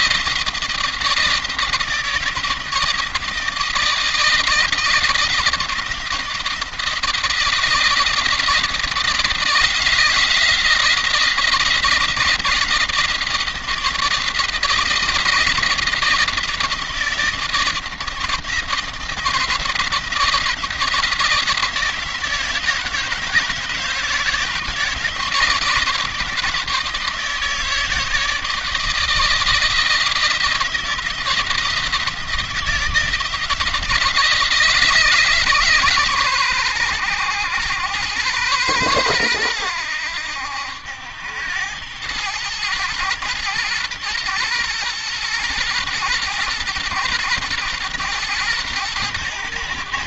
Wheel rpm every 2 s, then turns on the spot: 170, 160, 160, 160, 160, 170, 170, 170, 160, 170, 170, 160, 160, 160, 160, 170, 160, 150, 110, 110, 90, 110, 120, 120, 110.
none